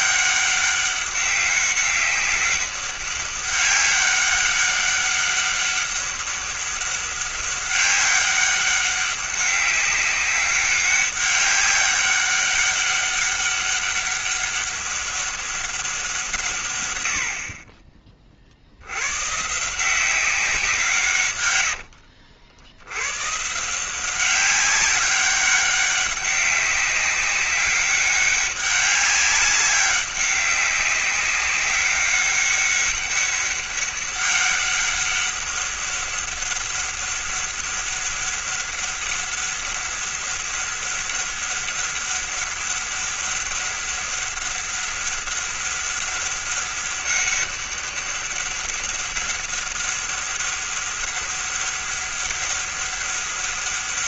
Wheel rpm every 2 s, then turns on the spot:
200, 200, 200, 200, 200, 200, 200, 200, 110, 80, 160, 110, 190, 200, 200, 200, 200, 200, 200, 200, 200, 200, 200, 200, 200, 200, 200.
none